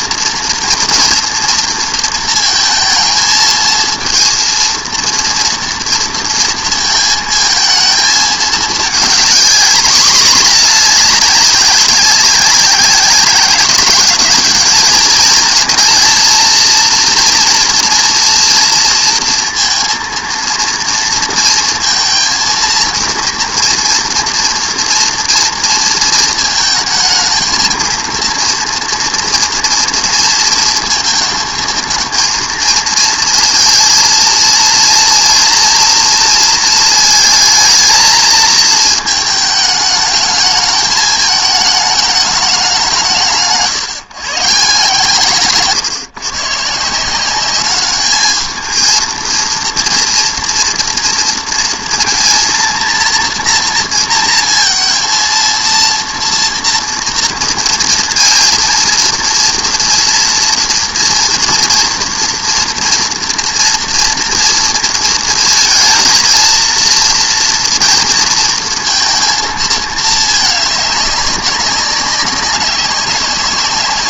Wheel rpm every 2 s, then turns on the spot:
230, 230, 230, 230, 220, 210, 200, 210, 230, 230, 230, 230, 230, 230, 230, 230, 220, 230, 230, 220, 220, 200, 160, 140, 220, 230, 230, 230, 230, 230, 230, 230, 230, 230, 230, 210, 190.
none